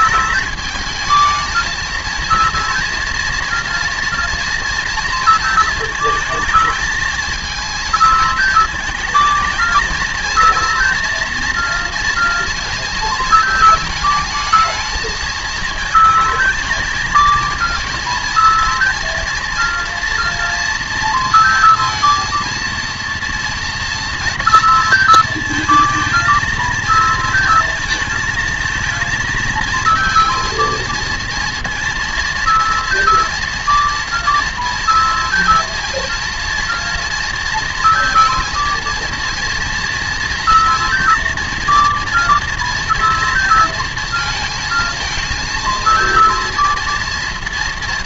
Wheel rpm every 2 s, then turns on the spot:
220, 230, 230, 230, 220, 230, 230, 220, 230, 230, 230, 230, 230, 220, 220, 230, 230, 230, 230, 230, 230, 230, 220, 230.
none